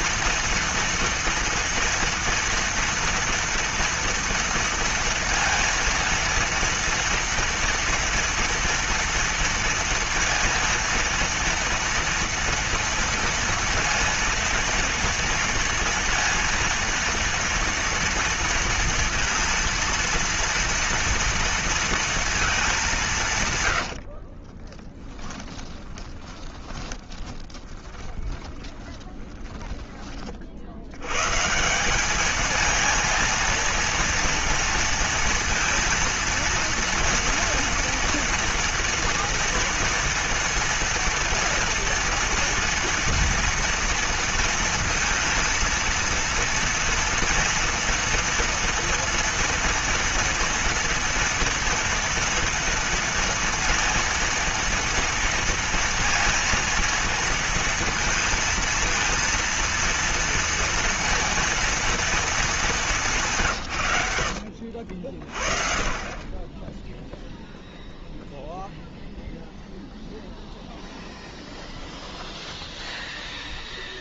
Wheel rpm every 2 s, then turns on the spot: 240, 240, 230, 230, 230, 230, 230, 230, 230, 230, 230, 210, 30, 20, 20, 50, 220, 230, 230, 230, 230, 230, 230, 230, 230, 230, 230, 230, 230, 230, 230, 220, 70, 20, 0, 0, 0.
24-30 64-66